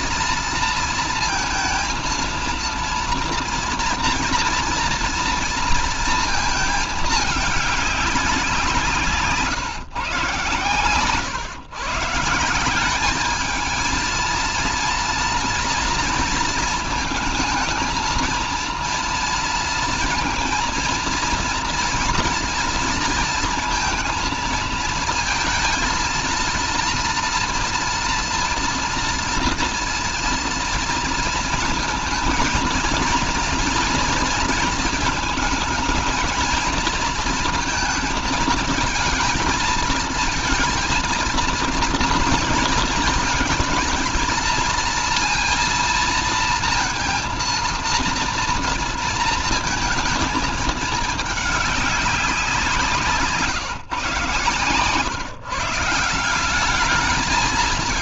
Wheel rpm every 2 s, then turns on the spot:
230, 230, 230, 220, 170, 130, 190, 230, 230, 230, 230, 230, 230, 230, 230, 230, 230, 230, 230, 220, 230, 230, 230, 230, 230, 220, 170, 130, 200.
none